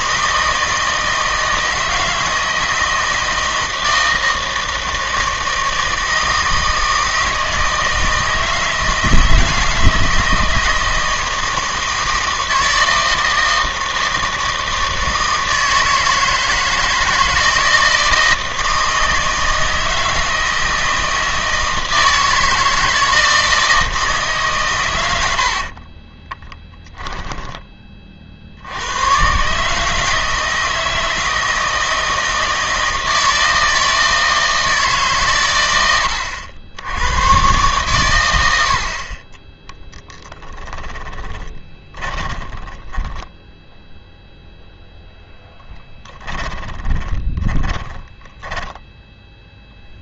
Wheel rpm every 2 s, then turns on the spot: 160, 160, 160, 160, 160, 160, 160, 160, 160, 160, 160, 160, 130, 20, 80, 160, 160, 160, 80, 80, 10, 20, 0, 20, 20.
26-28 40-44 46-50